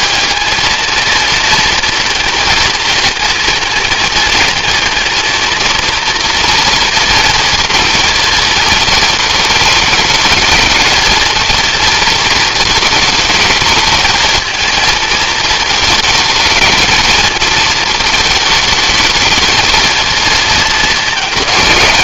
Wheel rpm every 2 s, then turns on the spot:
230, 220, 230, 230, 220, 230, 220, 220, 220, 220, 210.
none